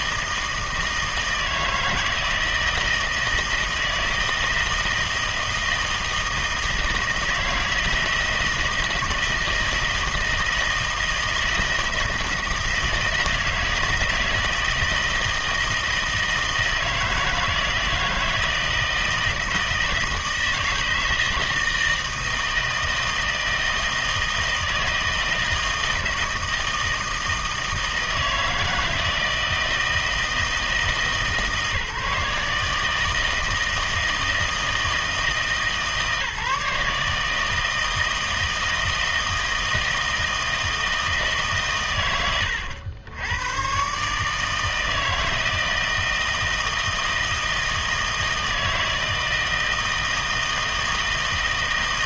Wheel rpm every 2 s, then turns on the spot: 160, 160, 160, 160, 160, 160, 160, 160, 160, 160, 160, 160, 160, 160, 160, 160, 150, 160, 150, 160, 160, 90, 160, 160, 160, 160.
none